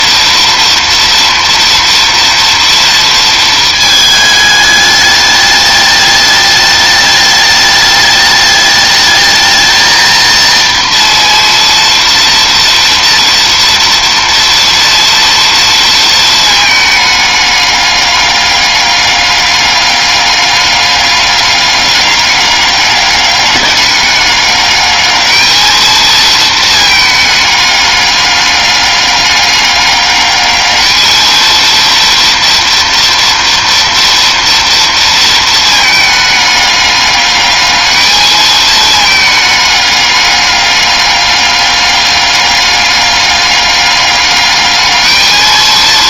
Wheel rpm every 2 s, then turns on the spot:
230, 230, 220, 210, 210, 230, 230, 230, 230, 200, 200, 200, 200, 220, 210, 200, 230, 230, 220, 220, 210, 200, 200.
none